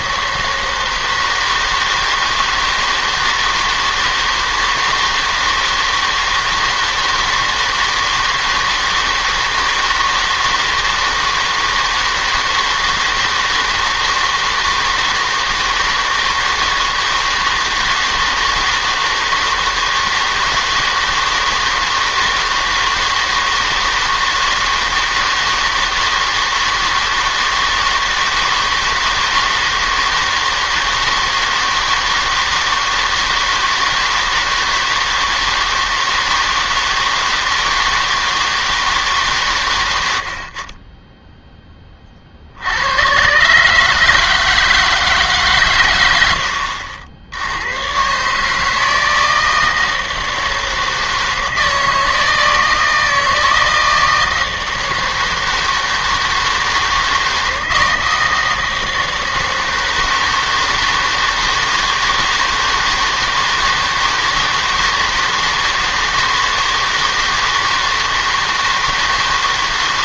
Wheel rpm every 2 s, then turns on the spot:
160, 160, 160, 160, 160, 160, 160, 160, 160, 160, 160, 160, 160, 160, 160, 160, 160, 160, 160, 160, 50, 70, 160, 80, 160, 160, 160, 160, 160, 160, 160, 160, 160, 160, 160.
none